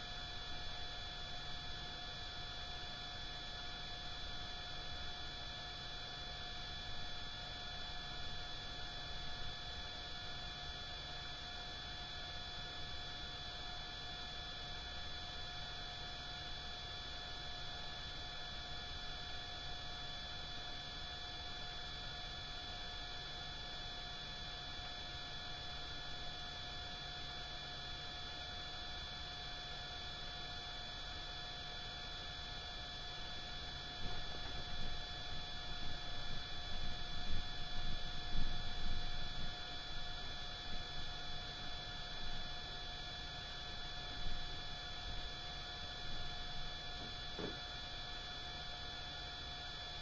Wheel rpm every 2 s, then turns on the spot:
0, 0, 0, 0, 0, 0, 0, 0, 0, 0, 0, 0, 0, 0, 0, 0, 0, 0, 0, 0, 0, 0, 0, 0, 0.
none